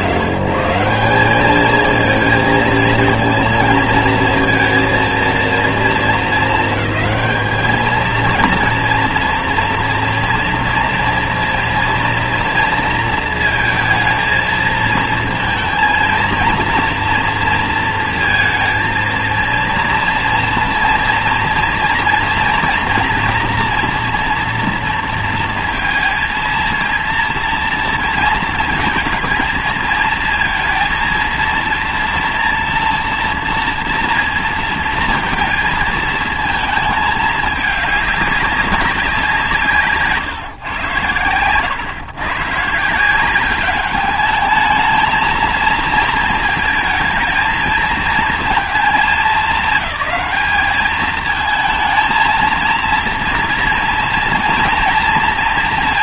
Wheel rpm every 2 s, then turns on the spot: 120, 230, 230, 220, 230, 230, 230, 230, 230, 230, 230, 230, 240, 230, 230, 230, 240, 230, 220, 200, 120, 150, 220, 220, 220, 210, 230, 230.
none